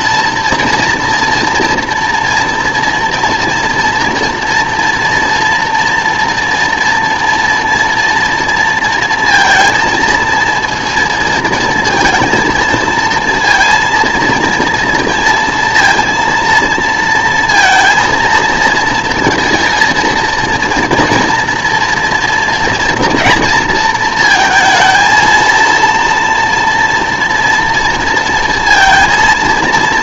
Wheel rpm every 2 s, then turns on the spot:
240, 230, 230, 230, 230, 230, 230, 230, 230, 230, 230, 230, 230, 230, 230.
none